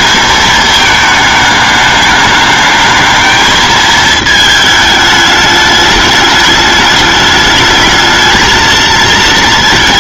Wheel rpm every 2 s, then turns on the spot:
220, 210, 220, 210, 220.
none